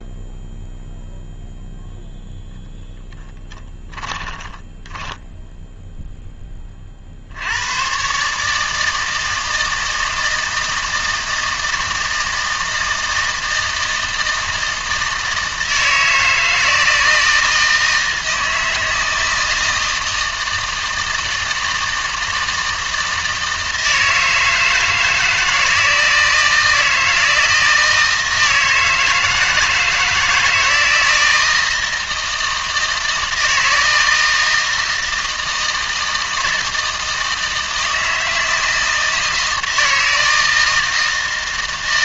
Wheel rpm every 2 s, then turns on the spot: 0, 20, 10, 30, 160, 160, 160, 160, 160, 160, 160, 160, 160, 160, 160, 160, 160, 160, 160, 160, 160.
4-6